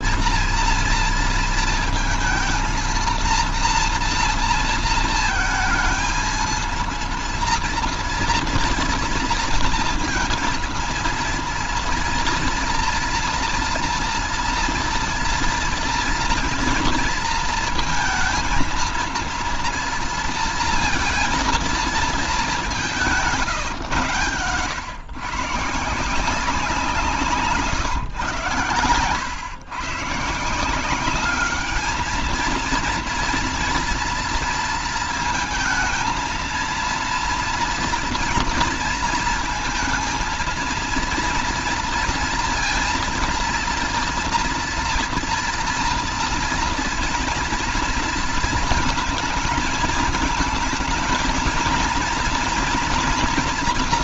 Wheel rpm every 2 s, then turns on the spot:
230, 230, 230, 230, 230, 230, 240, 230, 230, 230, 230, 190, 130, 170, 110, 180, 230, 230, 230, 230, 230, 230, 240, 230, 220, 220, 240.
none